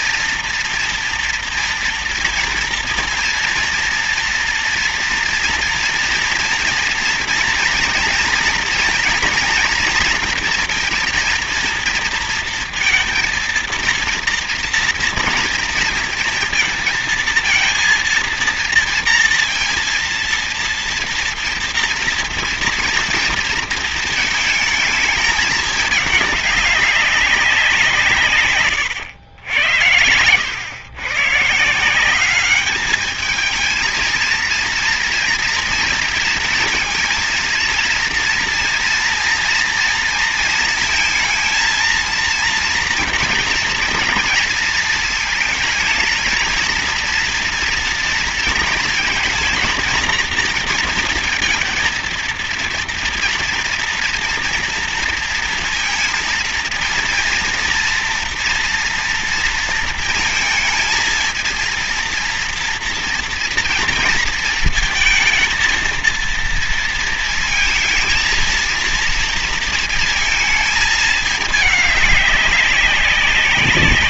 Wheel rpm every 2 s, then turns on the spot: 230, 230, 240, 230, 230, 230, 230, 240, 230, 230, 230, 240, 220, 200, 120, 110, 210, 230, 230, 230, 220, 230, 230, 230, 230, 230, 230, 230, 230, 230, 230, 230, 220, 230, 230, 220, 200.
none